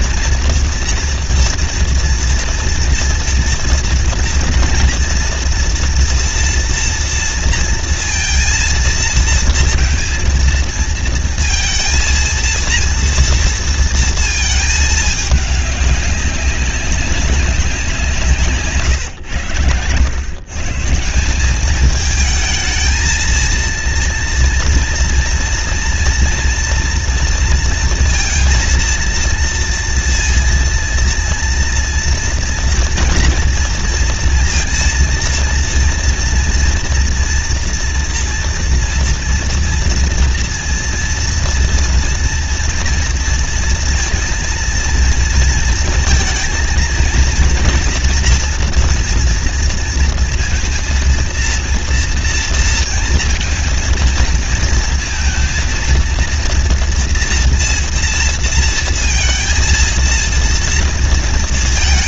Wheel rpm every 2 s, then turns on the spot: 230, 230, 230, 230, 230, 230, 230, 220, 200, 160, 140, 220, 230, 230, 230, 230, 230, 230, 240, 230, 230, 230, 230, 230, 240, 230, 230, 230, 230, 230, 230.
none